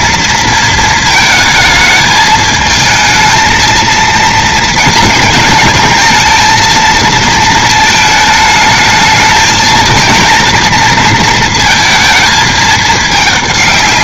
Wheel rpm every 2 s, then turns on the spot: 230, 220, 230, 230, 220, 230, 220.
none